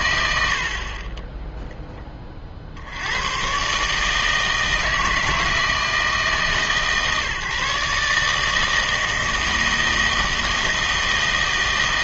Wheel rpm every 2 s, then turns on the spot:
60, 70, 160, 150, 160, 160.
none